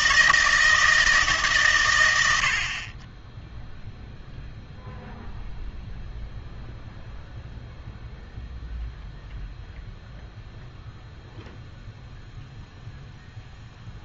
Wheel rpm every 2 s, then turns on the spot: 160, 50, 0, 0, 0, 0, 0.
none